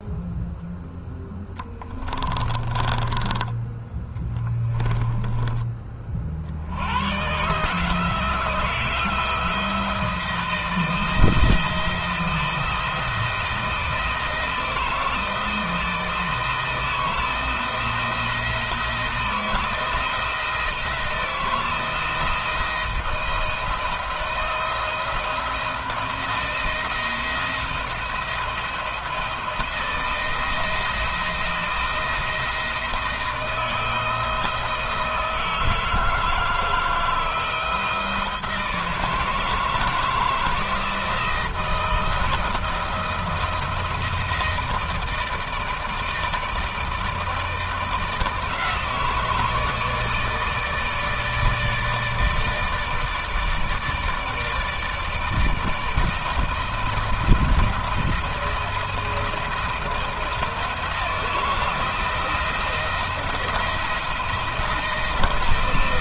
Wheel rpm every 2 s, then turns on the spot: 0, 20, 10, 60, 170, 160, 160, 160, 160, 170, 170, 170, 170, 170, 170, 160, 160, 160, 160, 160, 160, 170, 160, 160, 160, 160, 160, 160, 160, 170, 170, 170, 170.
2-4